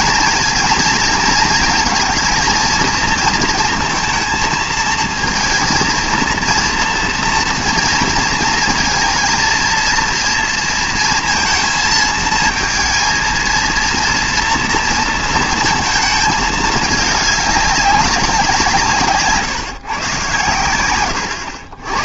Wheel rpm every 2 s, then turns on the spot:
230, 230, 220, 230, 230, 230, 220, 230, 210, 170, 110.
none